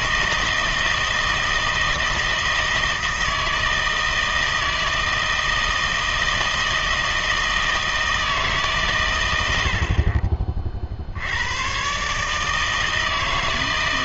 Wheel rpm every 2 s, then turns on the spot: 160, 160, 160, 160, 140, 50, 160.
none